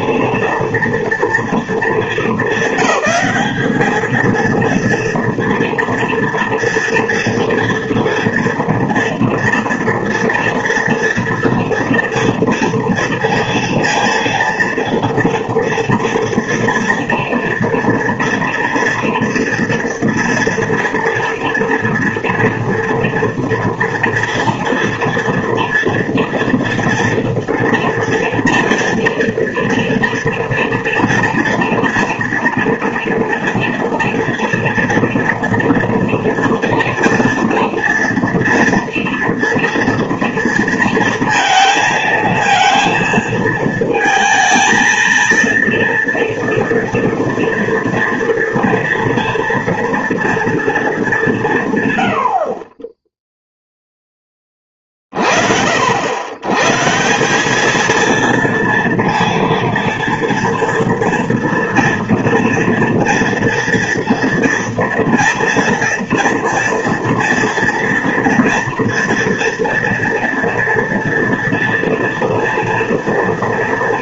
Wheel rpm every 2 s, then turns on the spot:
230, 200, 230, 230, 230, 230, 230, 230, 230, 230, 230, 240, 230, 230, 230, 230, 230, 230, 230, 230, 230, 230, 230, 230, 230, 220, 20, 30, 160, 230, 230, 230, 230, 230, 230, 230, 230.
none